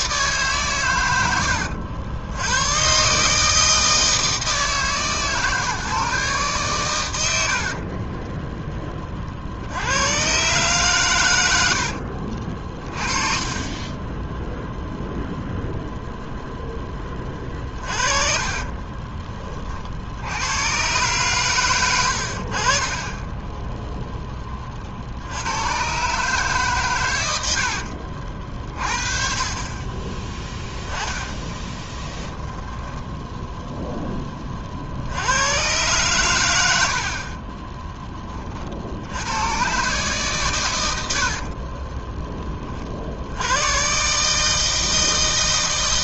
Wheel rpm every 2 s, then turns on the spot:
130, 110, 160, 130, 10, 120, 40, 0, 10, 40, 110, 50, 30, 130, 50, 10, 10, 40, 90, 40, 120, 30, 160.
12-14 18-20 30-34